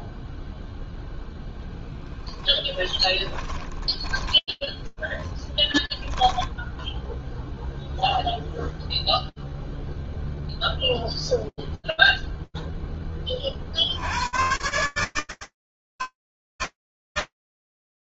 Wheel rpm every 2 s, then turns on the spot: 0, 10, 10, 0, 0, 0, 10, 150, 160.
2-4